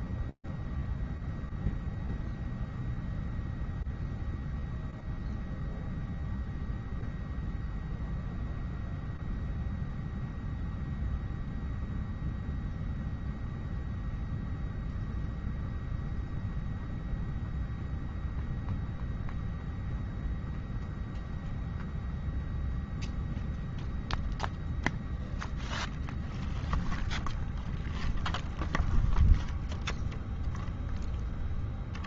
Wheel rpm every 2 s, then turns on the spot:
0, 0, 0, 0, 0, 0, 0, 0, 0, 0, 0, 0, 0, 0, 0, 0.
none